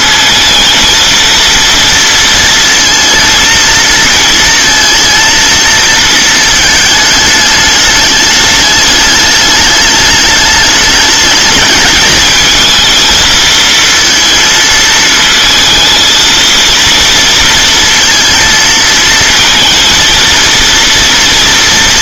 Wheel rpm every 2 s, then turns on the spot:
230, 230, 230, 220, 210, 210, 230, 220, 230, 230, 230.
none